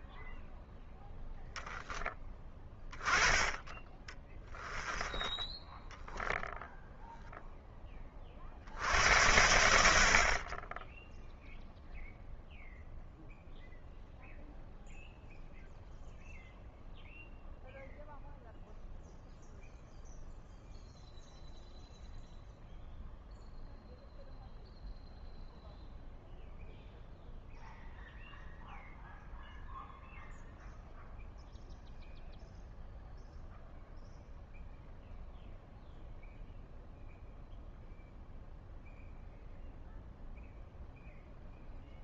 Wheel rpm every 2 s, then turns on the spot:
0, 10, 10, 0, 60, 20, 0, 0, 0, 0, 0, 0, 0, 0, 0, 0, 0, 0, 0, 0, 0.
none